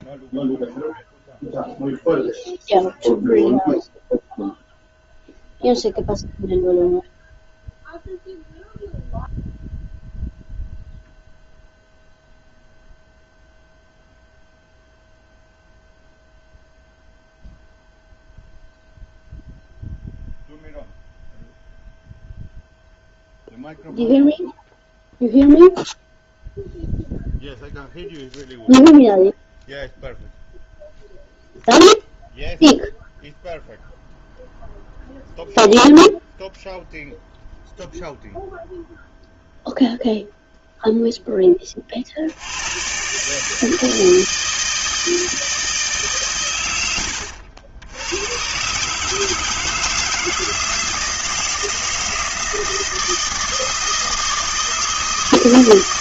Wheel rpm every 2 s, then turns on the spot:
0, 0, 0, 0, 0, 0, 0, 0, 0, 0, 0, 0, 0, 0, 0, 0, 0, 0, 0, 0, 0, 70, 160, 130, 100, 160, 160, 160.
none